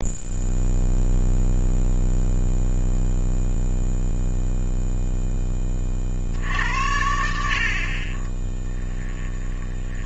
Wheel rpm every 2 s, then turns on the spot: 0, 0, 0, 80, 10.
8-10